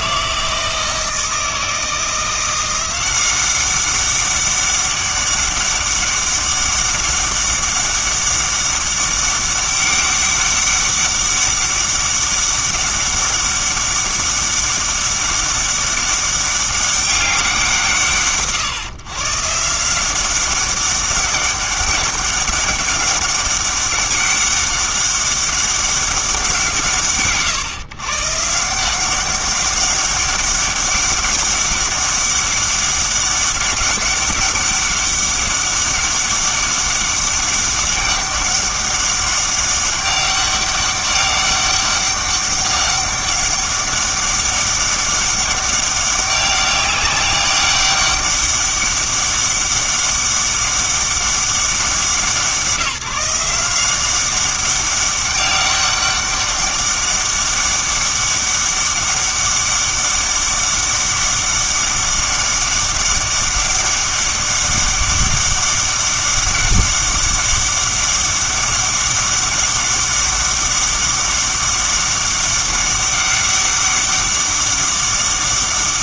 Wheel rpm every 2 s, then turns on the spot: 160, 180, 200, 200, 200, 200, 200, 200, 200, 120, 190, 200, 200, 140, 160, 200, 200, 200, 200, 200, 200, 200, 200, 200, 200, 200, 170, 190, 200, 200, 200, 200, 200, 200, 200, 200, 200, 200.
none